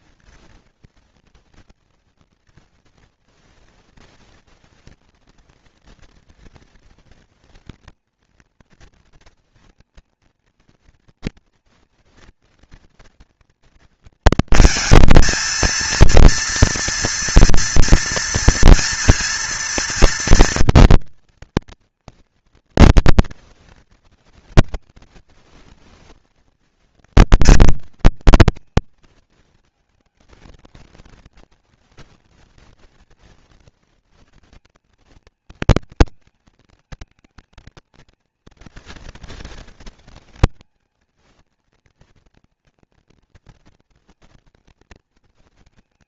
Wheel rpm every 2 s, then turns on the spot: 230, 230, 240, 230, 240, 240, 230, 230, 230, 230, 240, 230, 230, 230, 220, 220, 230, 220, 220, 230, 230, 230, 230.
none